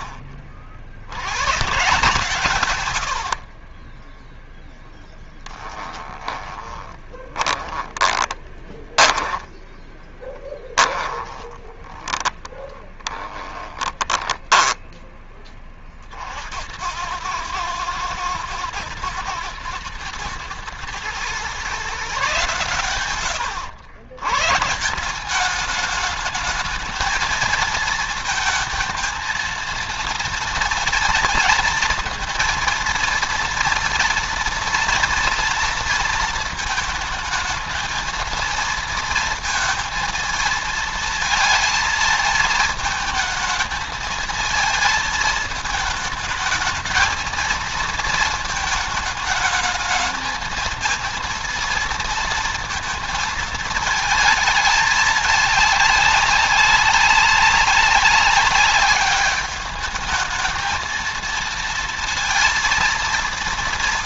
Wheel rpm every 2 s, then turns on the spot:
50, 130, 0, 20, 20, 20, 10, 10, 70, 110, 110, 130, 120, 220, 220, 230, 230, 230, 220, 220, 230, 220, 220, 220, 220, 220, 230, 210, 200, 200, 220, 230.
6-16